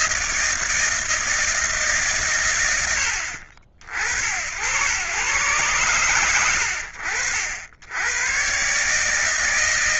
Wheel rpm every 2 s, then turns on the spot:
90, 140, 90, 160, 160.
none